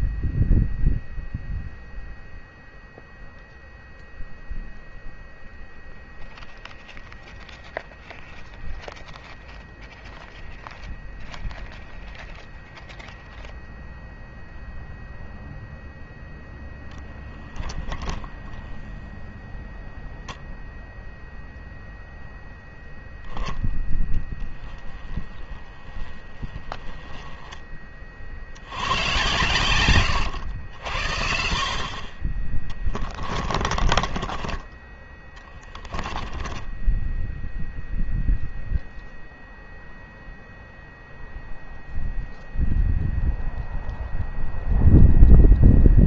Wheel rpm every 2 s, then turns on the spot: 0, 0, 0, 0, 0, 0, 0, 0, 0, 0, 0, 0, 10, 20, 80, 70, 30, 20, 10, 0, 0, 0, 0.
24-28 36-38